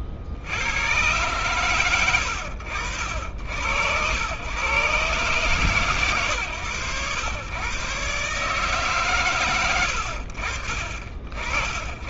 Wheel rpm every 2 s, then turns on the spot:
40, 80, 100, 120, 130, 50.
none